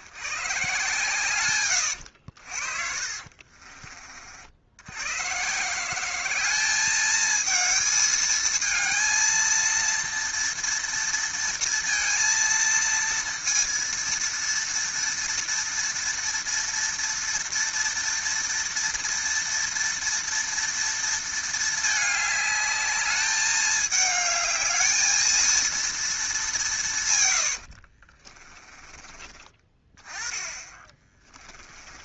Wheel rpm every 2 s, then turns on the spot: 130, 80, 50, 190, 220, 230, 230, 230, 230, 230, 230, 210, 210, 210, 30, 20.
2-4 28-30